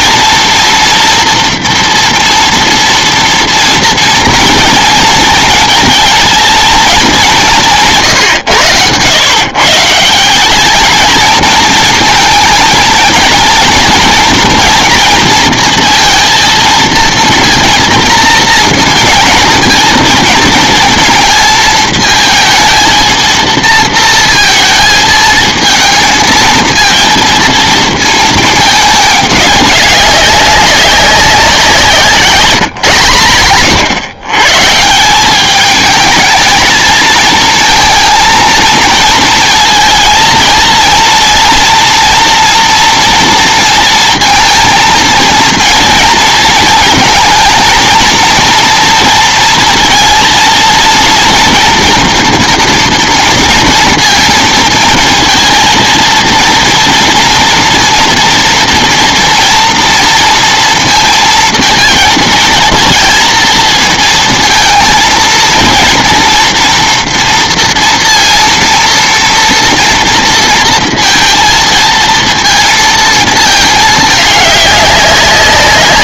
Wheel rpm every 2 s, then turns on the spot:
230, 230, 230, 230, 110, 200, 220, 230, 230, 230, 230, 220, 230, 220, 210, 190, 150, 130, 220, 230, 230, 230, 230, 230, 230, 230, 240, 230, 230, 240, 230, 230, 230, 240, 230, 230, 230, 200.
none